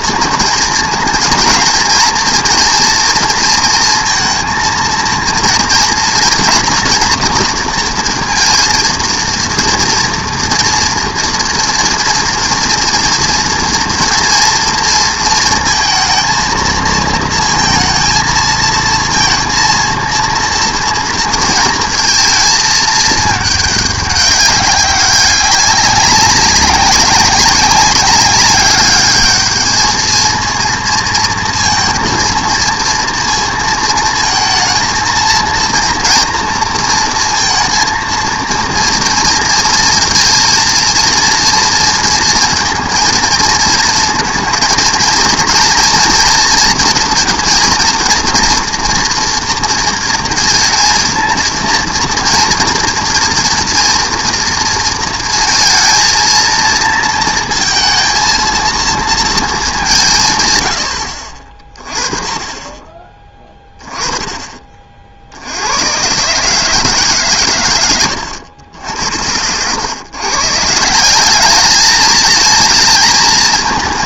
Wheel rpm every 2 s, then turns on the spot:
230, 230, 230, 230, 230, 230, 230, 230, 230, 230, 230, 220, 200, 190, 200, 230, 230, 220, 230, 230, 230, 230, 220, 230, 230, 230, 230, 230, 230, 220, 100, 20, 30, 150, 80, 150, 220.
none